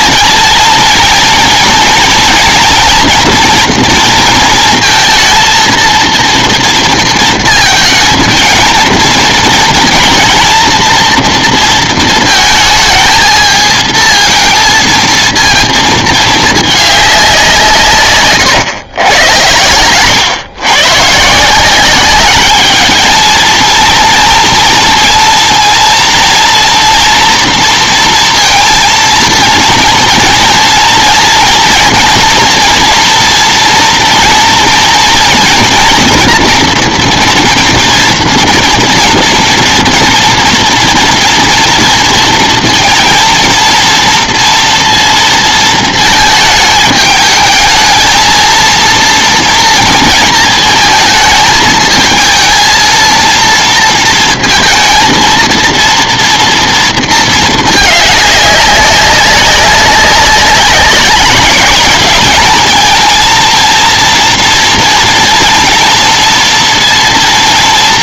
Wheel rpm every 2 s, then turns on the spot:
230, 240, 230, 230, 230, 230, 220, 230, 200, 110, 130, 220, 230, 230, 230, 230, 240, 240, 230, 230, 240, 230, 230, 220, 230, 220, 230, 230, 230, 200, 200, 220, 230, 230.
none